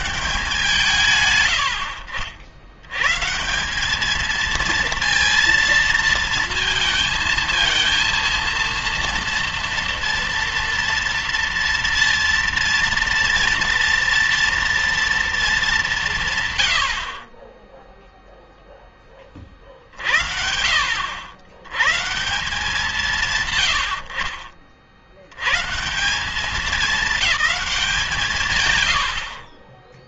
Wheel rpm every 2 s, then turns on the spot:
150, 100, 230, 230, 230, 230, 230, 230, 90, 10, 60, 170, 40, 210, 130.
none